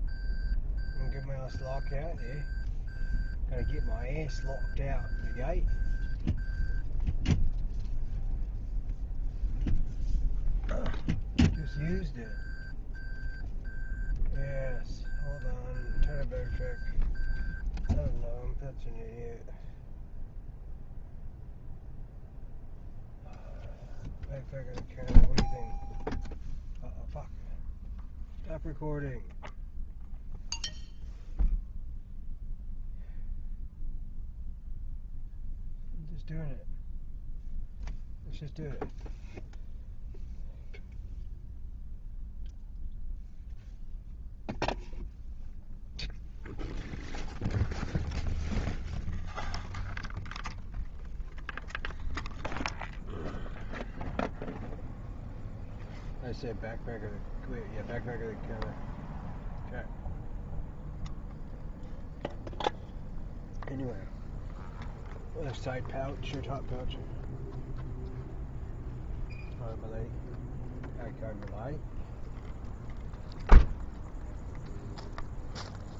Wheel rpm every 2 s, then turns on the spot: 0, 0, 0, 0, 0, 0, 0, 0, 0, 0, 0, 0, 0, 0, 0, 0, 0, 0, 0, 0, 0, 0, 0, 0, 0, 0, 0, 0, 0, 0, 0, 0, 0, 0, 0, 0, 0, 0.
none